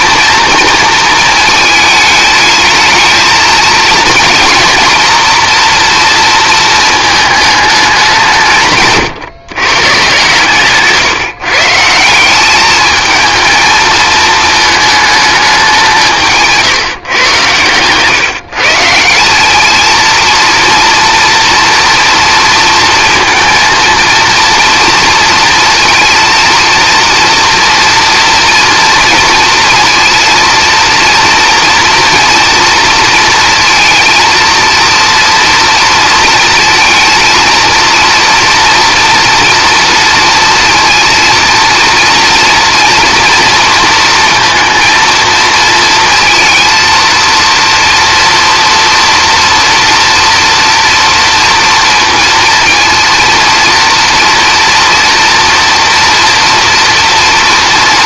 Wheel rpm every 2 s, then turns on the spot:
230, 220, 240, 230, 150, 150, 210, 220, 150, 150, 230, 230, 230, 230, 230, 230, 230, 230, 220, 230, 230, 230, 230, 220, 230, 230, 230, 230, 230.
none